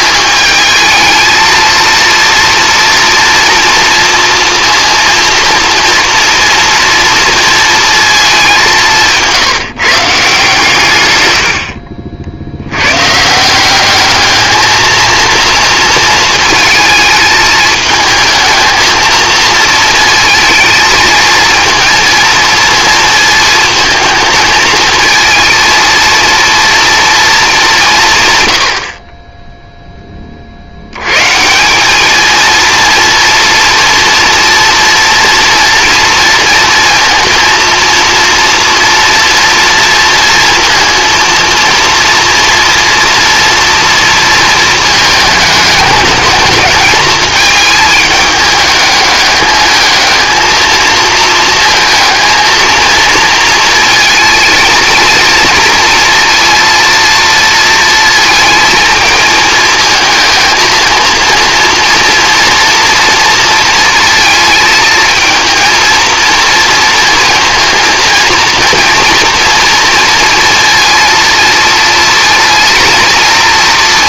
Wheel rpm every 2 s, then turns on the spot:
220, 230, 230, 230, 190, 140, 90, 220, 220, 220, 220, 230, 220, 230, 90, 70, 230, 230, 230, 230, 230, 240, 230, 210, 210, 220, 230, 230, 230, 230, 230, 240, 230, 230, 230, 230, 230.
none